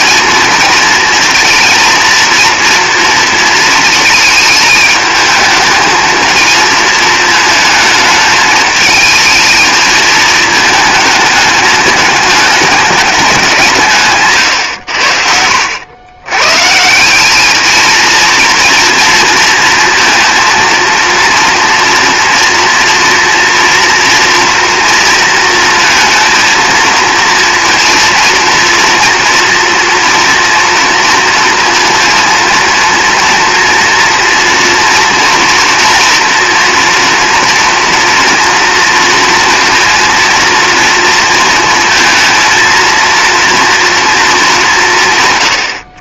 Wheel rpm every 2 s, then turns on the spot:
230, 230, 220, 220, 220, 220, 210, 100, 170, 230, 230, 240, 230, 230, 230, 230, 230, 230, 230, 230, 230, 230, 170.
none